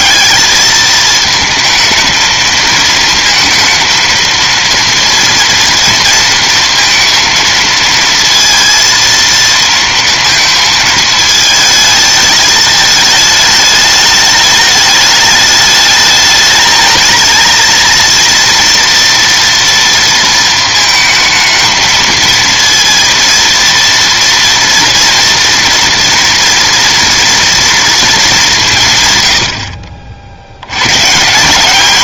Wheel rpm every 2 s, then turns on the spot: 220, 230, 230, 230, 230, 220, 210, 210, 220, 240, 230, 230, 230, 230, 90, 170.
none